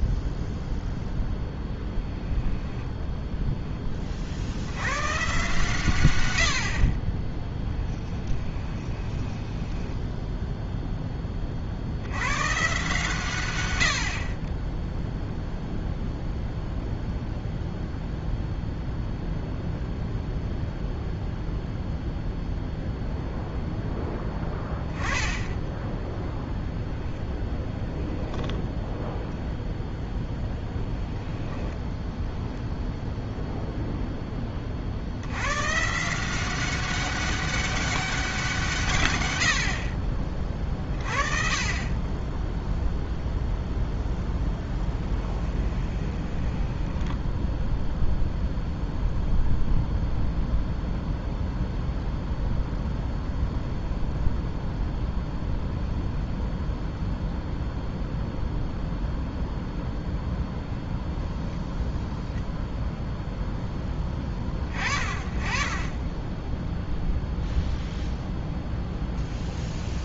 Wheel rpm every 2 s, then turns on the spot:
0, 10, 70, 80, 20, 0, 130, 10, 0, 0, 0, 0, 10, 0, 10, 10, 10, 40, 190, 160, 30, 0, 10, 10, 0, 0, 0, 0, 0, 0, 0, 0, 20, 0, 0.
8-10 44-48